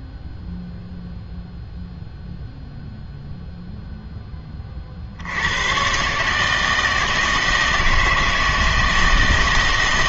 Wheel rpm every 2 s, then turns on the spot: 0, 0, 40, 160, 160.
none